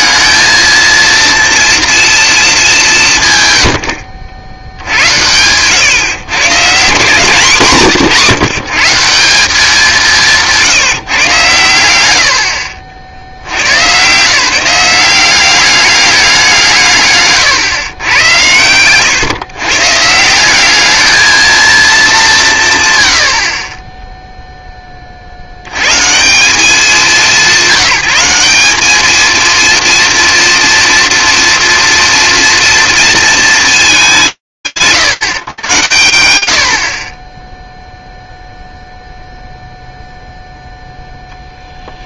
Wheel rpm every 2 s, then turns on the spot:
220, 200, 80, 150, 150, 170, 70, 170, 170, 100, 190, 160, 10, 180, 200, 240, 230, 120, 70, 0, 0.
none